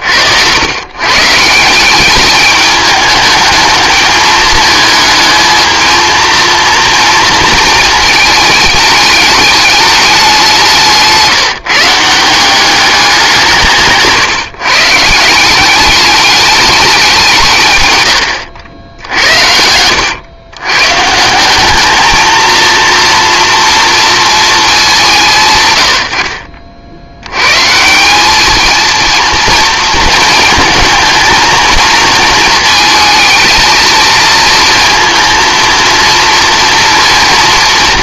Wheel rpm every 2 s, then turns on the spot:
100, 210, 210, 230, 220, 180, 190, 150, 210, 100, 120, 230, 210, 60, 220, 230, 230, 230, 230.
none